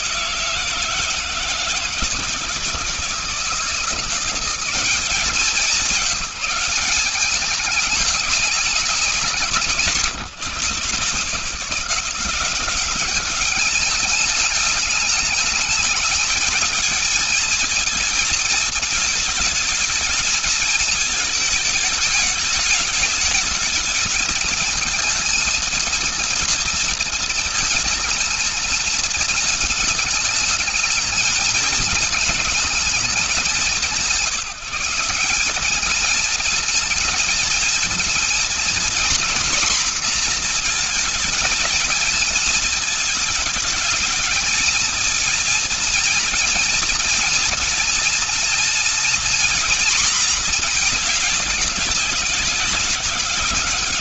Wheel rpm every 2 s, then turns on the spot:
170, 160, 190, 180, 190, 170, 190, 210, 220, 220, 220, 220, 220, 230, 220, 220, 210, 160, 220, 240, 240, 220, 230, 230, 230, 230, 190.
none